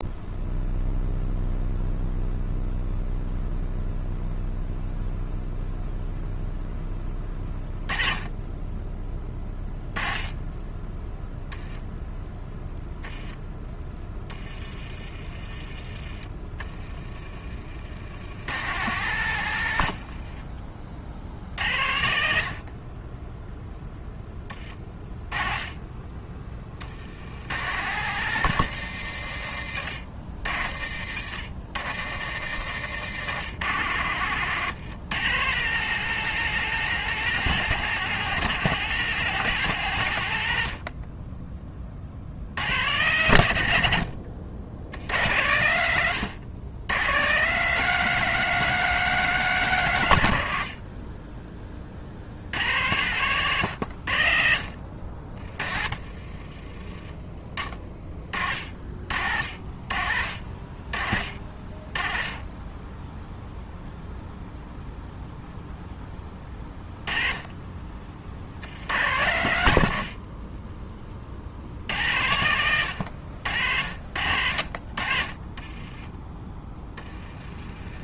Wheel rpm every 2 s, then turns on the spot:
0, 0, 0, 10, 20, 10, 10, 20, 30, 130, 60, 30, 20, 60, 120, 80, 120, 130, 180, 180, 50, 110, 80, 110, 170, 40, 110, 60, 20, 50, 40, 10, 0, 20, 90, 30, 100, 50, 30.
12-14 54-56 76-78